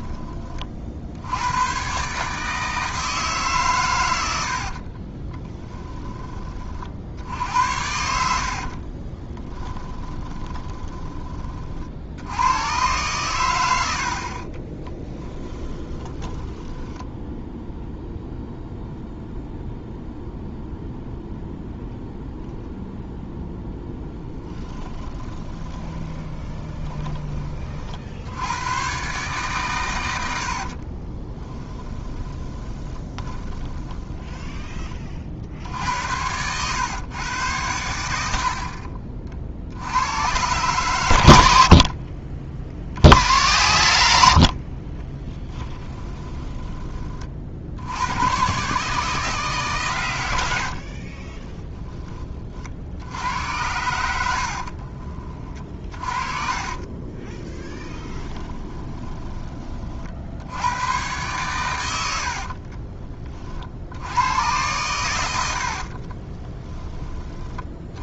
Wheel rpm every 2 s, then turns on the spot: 50, 160, 60, 50, 50, 20, 110, 20, 10, 0, 0, 0, 10, 20, 110, 50, 20, 20, 110, 50, 120, 50, 50, 20, 130, 70, 50, 50, 40, 10, 100, 40, 110, 20.
4-6 8-12 14-18 24-26 30-34 50-52 54-60 62-64 66-68